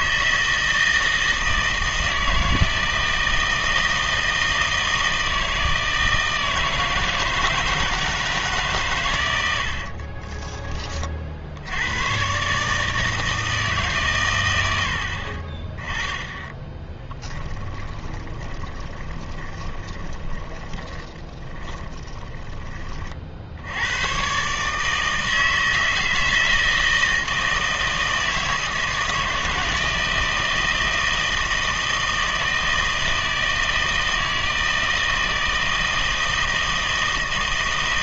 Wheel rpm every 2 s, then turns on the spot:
160, 160, 160, 160, 140, 30, 140, 90, 10, 20, 20, 30, 150, 160, 160, 160, 160, 160, 160.
16-24